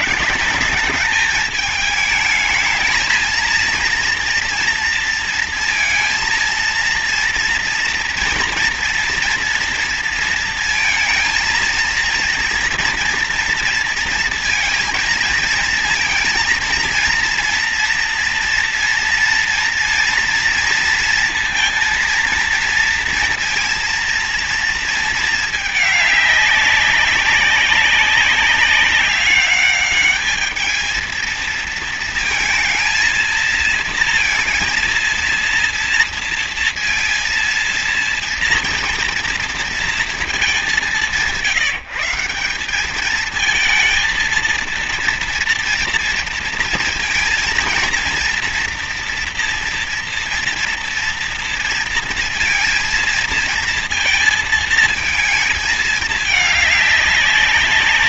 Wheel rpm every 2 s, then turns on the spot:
210, 220, 230, 230, 230, 220, 230, 230, 230, 230, 230, 230, 230, 200, 200, 220, 230, 230, 230, 230, 200, 190, 230, 230, 230, 230, 230, 230, 210.
none